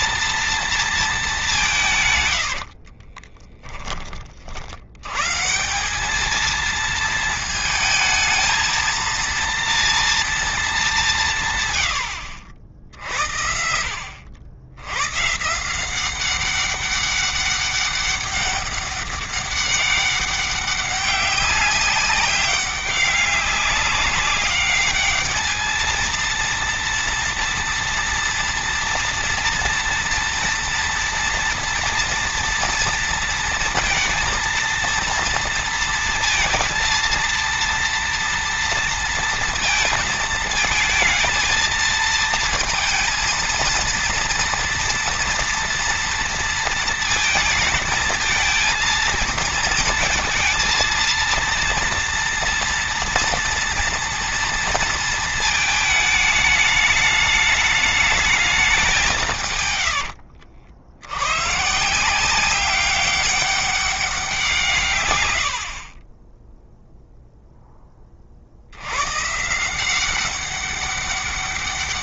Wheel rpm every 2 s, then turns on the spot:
220, 60, 80, 230, 230, 200, 60, 100, 190, 200, 200, 190, 210, 230, 240, 230, 230, 230, 230, 230, 230, 230, 230, 230, 230, 230, 230, 230, 210, 200, 80, 190, 130, 0, 90, 190.
2-4